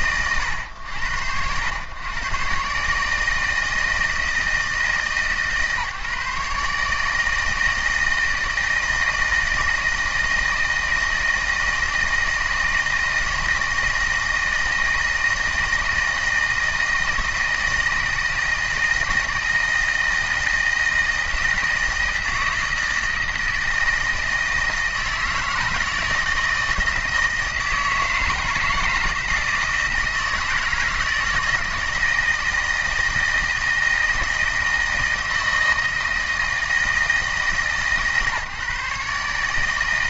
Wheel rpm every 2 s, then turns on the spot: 110, 120, 160, 150, 160, 160, 160, 160, 160, 160, 160, 160, 160, 160, 160, 160, 160, 160, 160, 150.
none